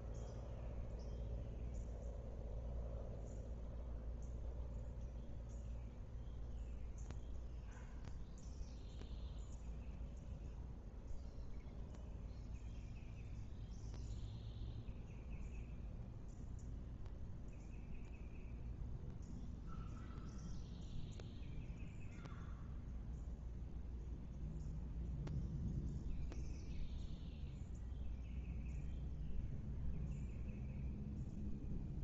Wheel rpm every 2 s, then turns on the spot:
0, 0, 0, 0, 0, 0, 0, 0, 0, 0, 0, 0, 0, 0, 0, 0.
none